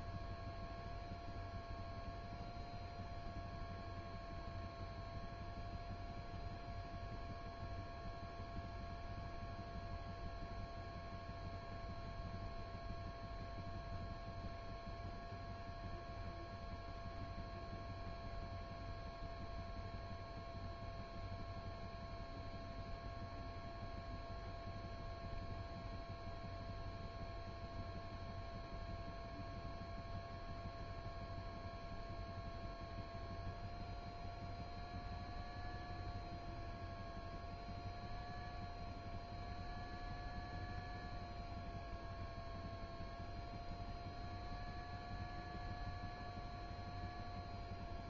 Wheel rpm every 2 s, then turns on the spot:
0, 0, 0, 0, 0, 0, 0, 0, 0, 0, 0, 0, 0, 0, 0, 0, 0, 0, 0, 0, 0, 0, 0, 0.
none